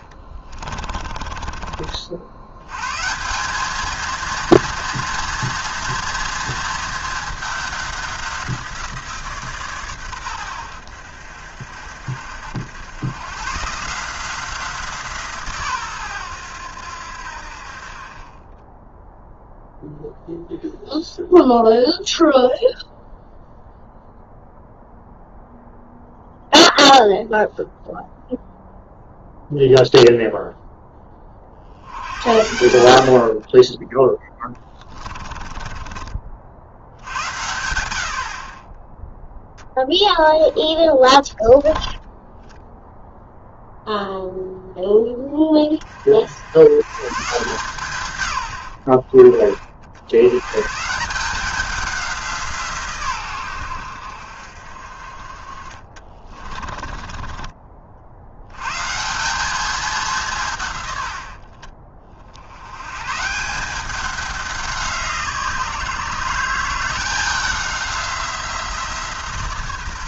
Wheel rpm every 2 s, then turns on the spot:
30, 110, 230, 220, 180, 90, 90, 180, 90, 10, 0, 0, 0, 0, 0, 0, 80, 20, 60, 30, 10, 0, 0, 90, 100, 140, 160, 50, 30, 110, 140, 80, 190, 170, 170.
0-2 34-36 56-58